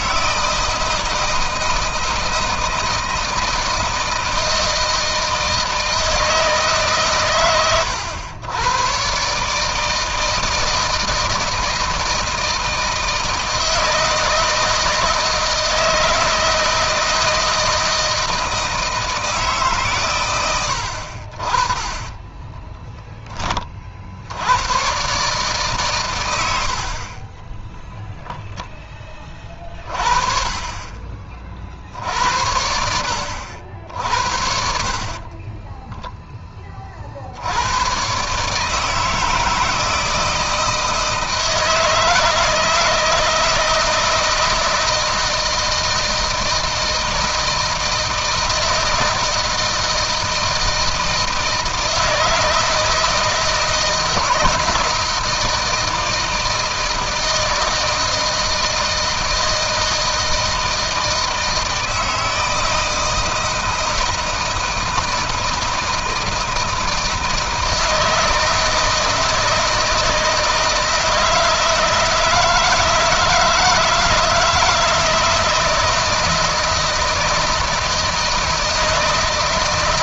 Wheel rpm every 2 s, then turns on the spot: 160, 160, 160, 130, 120, 160, 160, 160, 160, 160, 80, 10, 120, 50, 20, 30, 70, 40, 40, 150, 160, 160, 160, 160, 160, 160, 160, 160, 160, 160, 160, 160, 160, 160, 160, 160, 160, 160, 160, 160.
34-36